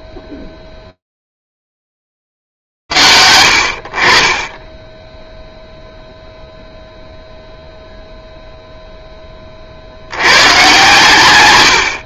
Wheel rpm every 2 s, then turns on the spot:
0, 20, 40, 0, 0, 100.
none